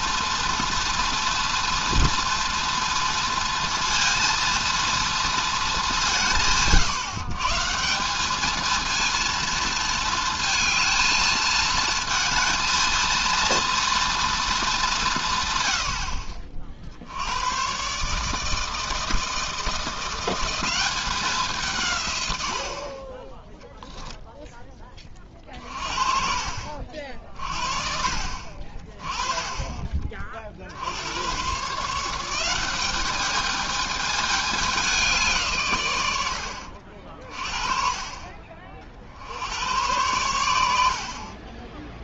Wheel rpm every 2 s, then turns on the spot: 230, 240, 230, 150, 220, 230, 230, 220, 60, 160, 190, 60, 10, 50, 40, 70, 190, 200, 60, 40, 70.
none